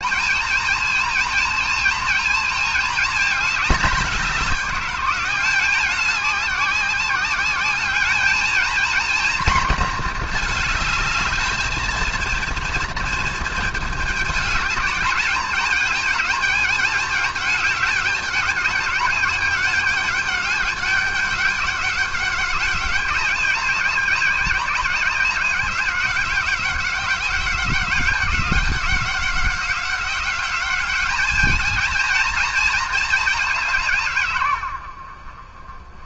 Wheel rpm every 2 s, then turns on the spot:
220, 220, 200, 200, 230, 220, 230, 210, 210, 210, 200, 190, 190, 190, 190, 200, 220, 110.
none